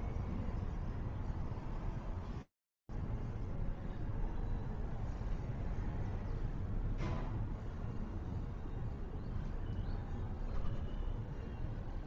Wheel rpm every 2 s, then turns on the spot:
0, 0, 0, 0, 0, 0.
none